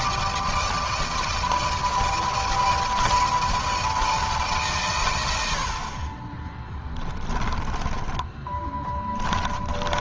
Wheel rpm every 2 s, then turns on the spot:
160, 170, 130, 20, 20.
6-10